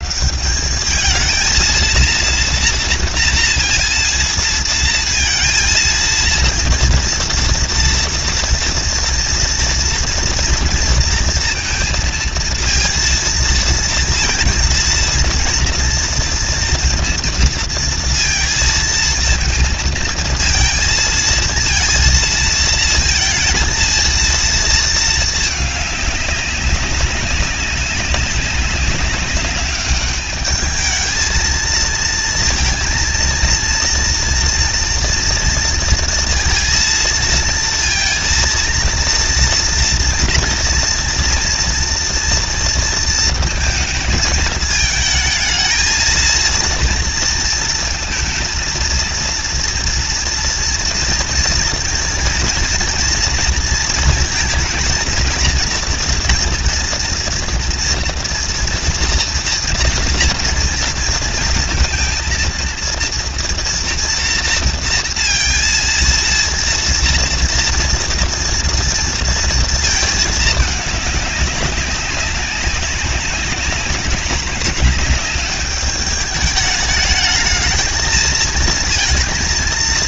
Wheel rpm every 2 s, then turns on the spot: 190, 230, 230, 230, 230, 240, 230, 230, 230, 230, 230, 230, 220, 200, 190, 210, 230, 230, 230, 230, 230, 230, 220, 230, 230, 230, 230, 230, 230, 240, 230, 230, 230, 230, 230, 220, 190, 190, 210, 220.
none